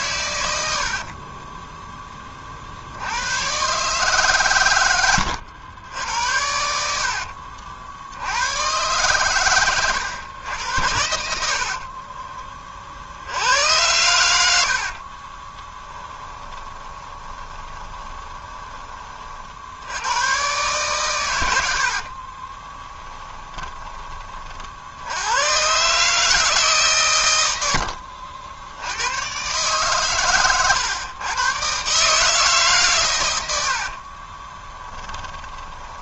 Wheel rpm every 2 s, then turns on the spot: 70, 70, 110, 70, 130, 100, 50, 60, 20, 30, 130, 20, 60, 130, 80, 130, 130, 10.
6-8 14-18 22-24 34-36